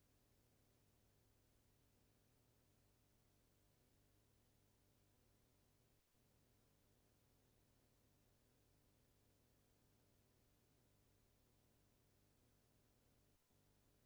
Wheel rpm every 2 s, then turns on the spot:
0, 0, 0, 0, 0, 0, 0.
none